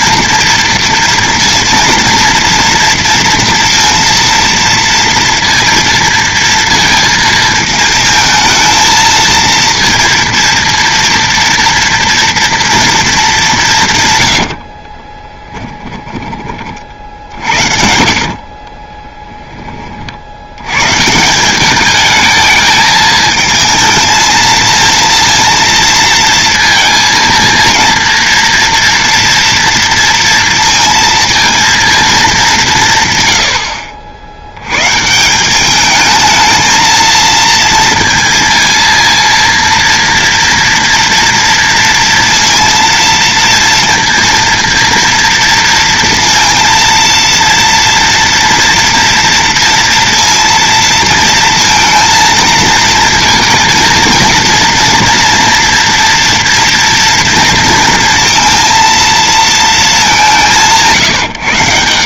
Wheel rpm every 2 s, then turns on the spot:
230, 230, 230, 230, 220, 230, 230, 40, 40, 30, 140, 220, 230, 230, 230, 230, 150, 140, 220, 230, 230, 230, 230, 230, 240, 230, 230, 230, 230, 230, 170.
14-20